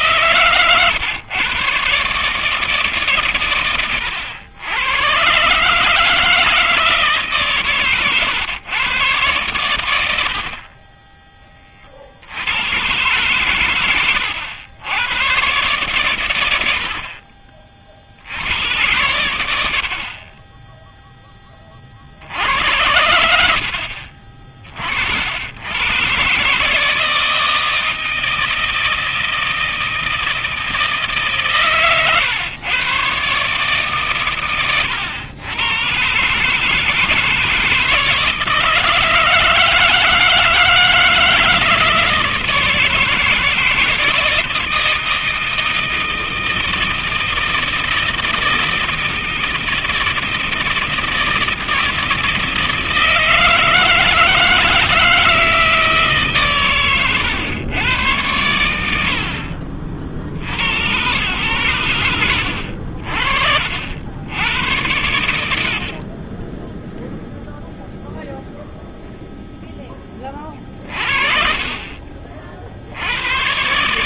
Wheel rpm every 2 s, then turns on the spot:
120, 150, 100, 160, 120, 40, 130, 90, 70, 90, 10, 80, 50, 160, 160, 150, 120, 110, 160, 160, 160, 160, 160, 160, 160, 160, 160, 160, 120, 80, 110, 60, 90, 20, 0, 30, 50.
none